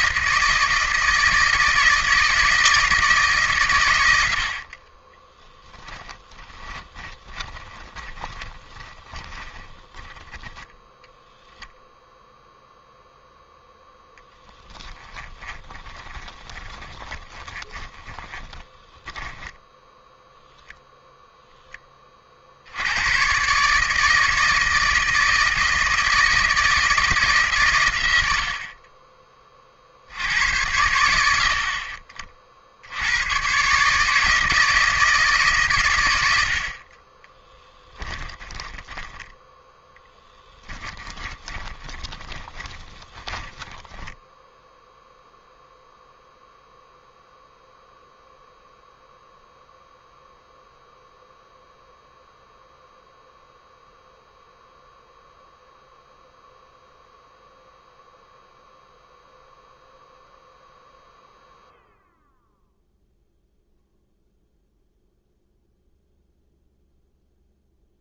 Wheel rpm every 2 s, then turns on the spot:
160, 160, 40, 20, 20, 10, 0, 10, 20, 20, 0, 70, 160, 160, 40, 100, 70, 160, 50, 10, 10, 20, 0, 0, 0, 0, 0, 0, 0, 0, 0, 0, 0, 0.
6-12 14-20 38-44